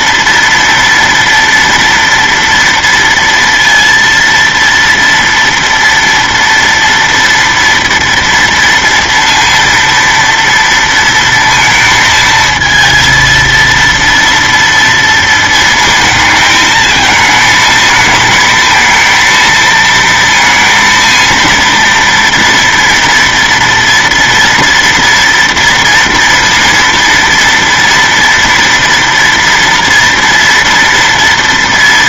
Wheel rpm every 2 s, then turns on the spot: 230, 230, 230, 230, 230, 230, 230, 230, 220, 230, 230, 230, 230, 230, 240, 230.
none